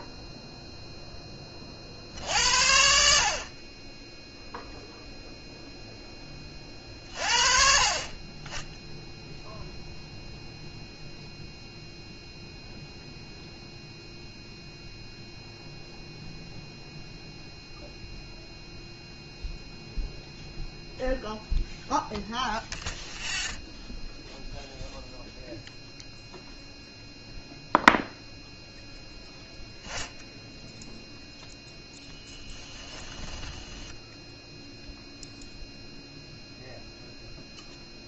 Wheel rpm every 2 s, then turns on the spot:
0, 80, 0, 30, 10, 0, 0, 0, 0, 0, 0, 0, 0, 0, 0, 0, 20, 0, 0.
32-34